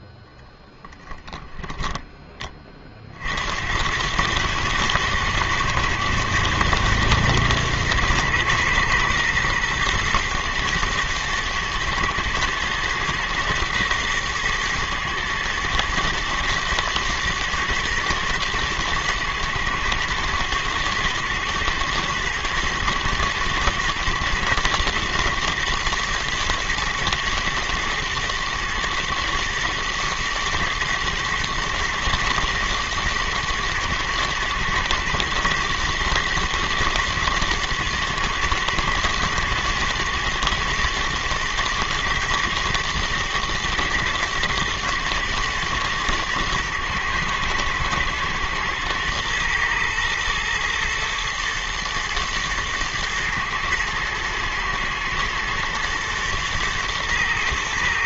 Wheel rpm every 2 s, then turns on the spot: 10, 60, 120, 110, 110, 110, 120, 110, 110, 120, 110, 110, 120, 110, 110, 120, 120, 120, 120, 110, 120, 110, 110, 120, 120, 110, 110, 110, 110.
none